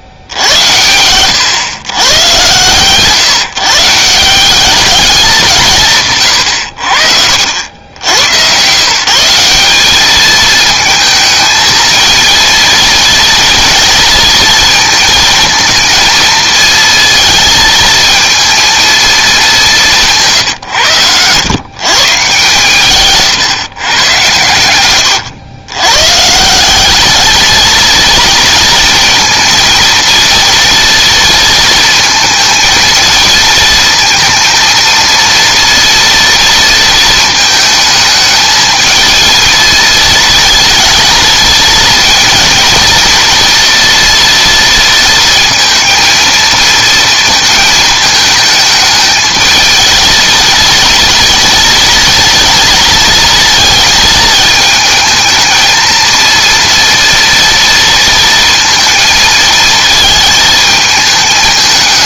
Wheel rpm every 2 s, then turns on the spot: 90, 130, 200, 70, 140, 220, 230, 230, 230, 230, 130, 140, 110, 190, 230, 230, 230, 230, 230, 220, 230, 230, 230, 230, 220, 230, 230, 220, 230, 230, 220.
none